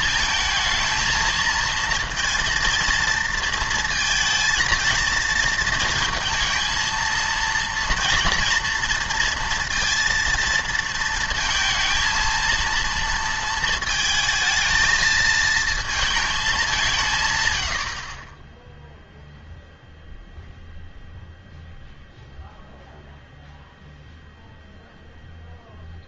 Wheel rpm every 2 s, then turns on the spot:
220, 230, 230, 220, 230, 230, 230, 220, 190, 0, 0, 0, 0.
none